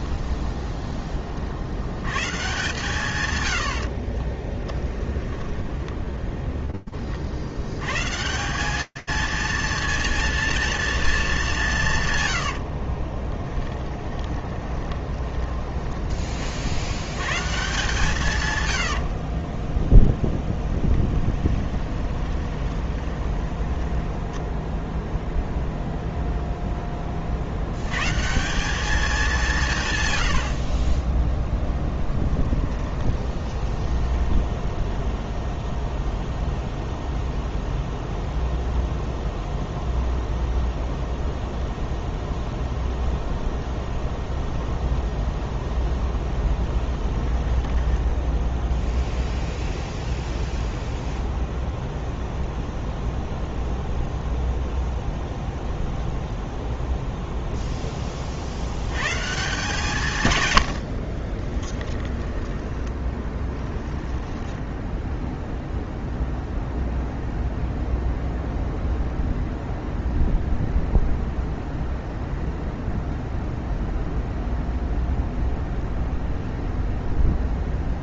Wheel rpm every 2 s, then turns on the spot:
10, 140, 10, 20, 220, 230, 50, 10, 90, 90, 10, 20, 0, 20, 200, 30, 30, 0, 0, 0, 0, 0, 0, 10, 0, 0, 0, 0, 0, 110, 70, 20, 0, 0, 0, 0, 0, 0, 0.
4-6 12-16 18-24 30-34 46-48 60-64